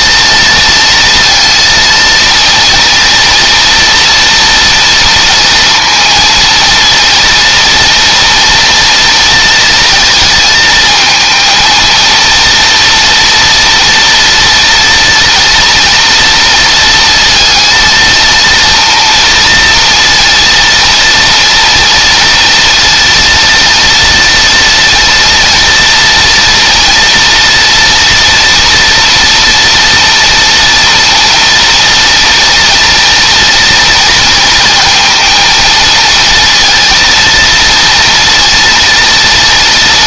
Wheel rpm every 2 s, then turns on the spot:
230, 230, 230, 230, 230, 220, 230, 230, 230, 240, 230, 230, 230, 230, 230, 230, 230, 230, 230, 230.
none